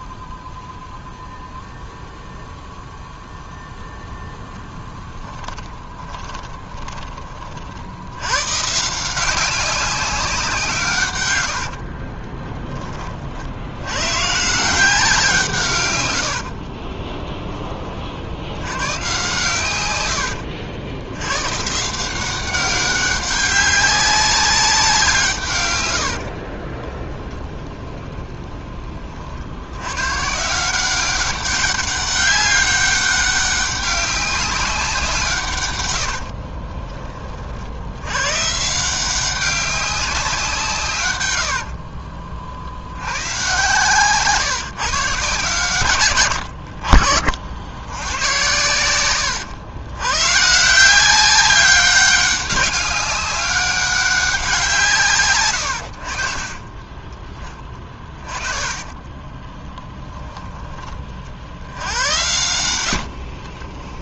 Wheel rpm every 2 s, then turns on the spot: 0, 0, 10, 20, 160, 140, 20, 180, 30, 110, 80, 190, 180, 10, 20, 190, 200, 190, 30, 170, 130, 90, 140, 60, 100, 170, 190, 150, 20, 10, 30, 80.
4-6 16-18 26-28 48-50 56-60 62-64